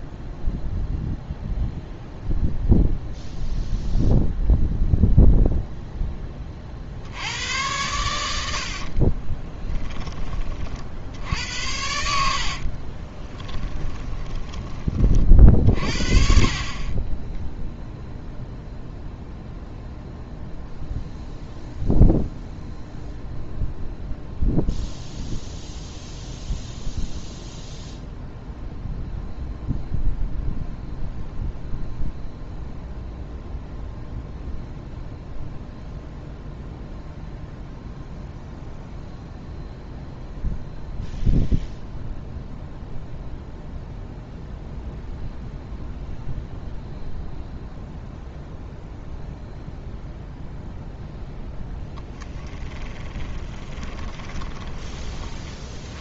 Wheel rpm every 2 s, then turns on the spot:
0, 0, 0, 40, 60, 50, 40, 30, 40, 0, 0, 0, 0, 0, 0, 0, 0, 0, 0, 0, 0, 0, 0, 0, 0, 0, 20, 20.
8-10 12-14 52-54